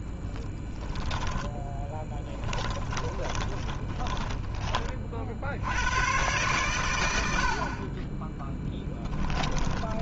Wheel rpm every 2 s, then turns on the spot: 10, 10, 20, 120, 10.
0-4